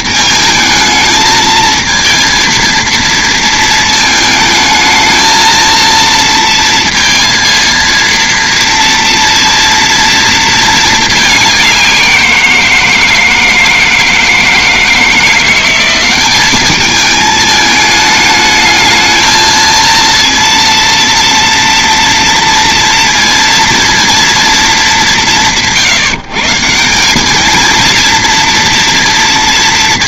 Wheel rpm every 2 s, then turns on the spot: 220, 230, 220, 230, 230, 220, 170, 160, 200, 220, 230, 230, 220, 160, 230.
none